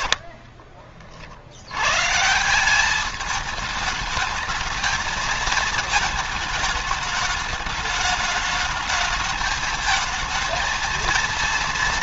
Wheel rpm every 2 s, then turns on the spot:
40, 200, 220, 210, 210, 220.
none